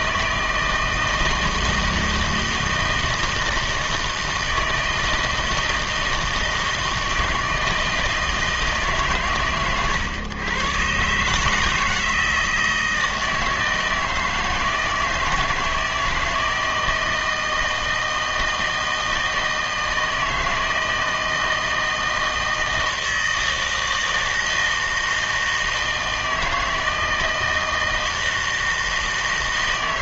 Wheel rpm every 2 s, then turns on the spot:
160, 160, 160, 160, 150, 130, 160, 160, 160, 160, 160, 160, 160, 160, 160.
none